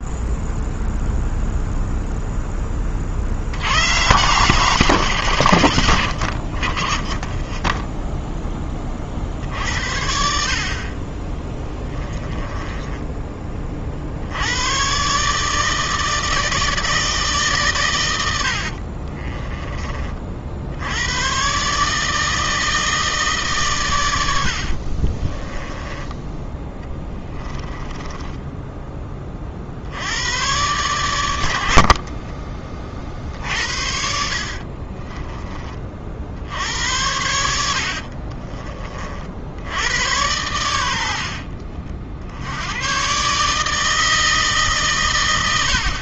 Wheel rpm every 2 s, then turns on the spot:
0, 40, 160, 30, 30, 30, 10, 120, 160, 40, 90, 160, 50, 10, 20, 110, 40, 40, 90, 40, 90, 120, 130.
12-14 18-20 24-28 34-36